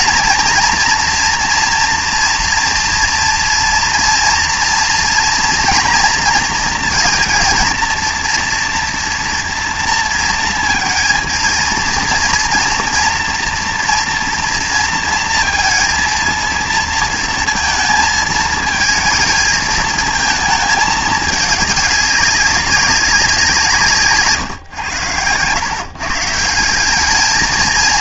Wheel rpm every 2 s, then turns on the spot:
240, 240, 230, 230, 230, 230, 230, 230, 230, 220, 210, 190, 110, 200.
none